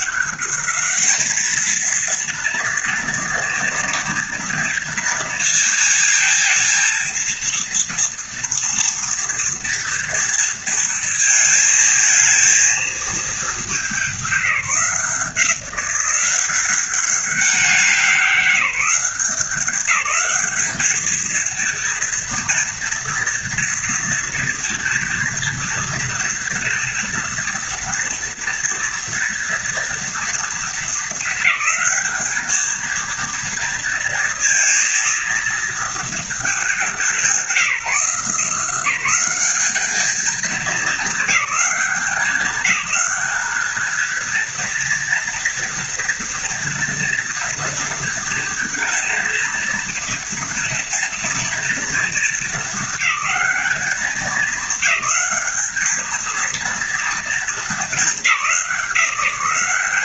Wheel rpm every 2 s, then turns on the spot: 210, 230, 230, 230, 230, 230, 230, 180, 190, 190, 220, 230, 230, 230, 230, 220, 220, 230, 200, 180, 220, 190, 230, 230, 230, 230, 200, 210, 230, 180.
none